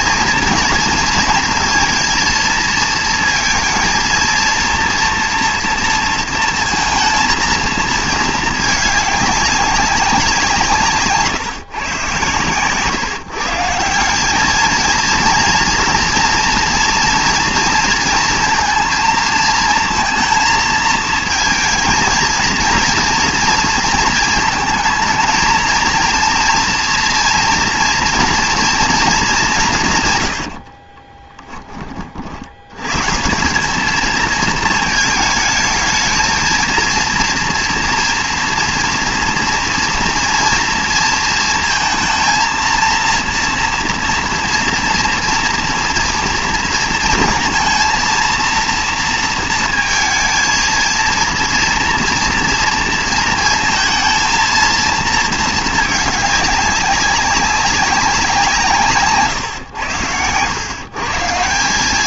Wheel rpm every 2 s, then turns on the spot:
220, 230, 230, 230, 210, 170, 130, 210, 230, 230, 220, 230, 220, 240, 230, 90, 80, 220, 230, 230, 230, 230, 240, 230, 230, 220, 230, 230, 200, 180, 100.
30-32